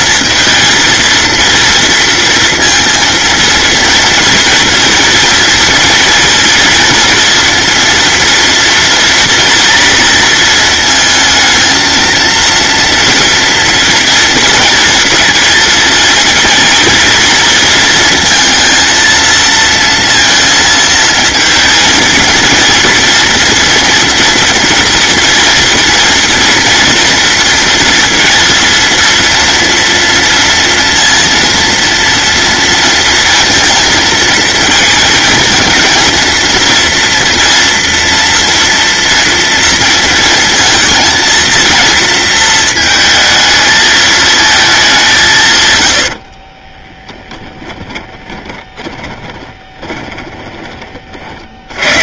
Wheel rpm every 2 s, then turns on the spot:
230, 230, 230, 230, 240, 230, 230, 230, 230, 230, 220, 230, 230, 240, 230, 230, 230, 220, 230, 230, 230, 220, 180, 10, 20, 30.
46-50